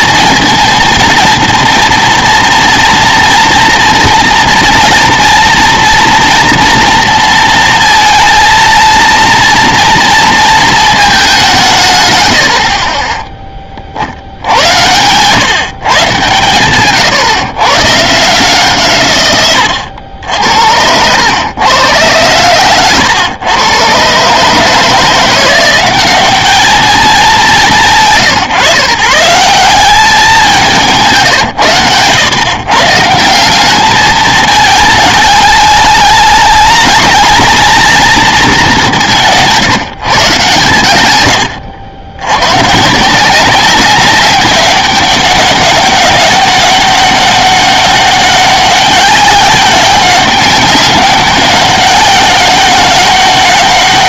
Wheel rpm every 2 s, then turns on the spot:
230, 230, 230, 230, 230, 230, 70, 90, 130, 160, 80, 120, 140, 210, 150, 190, 120, 220, 210, 210, 130, 120, 200, 200, 200, 200, 190.
16-18 20-22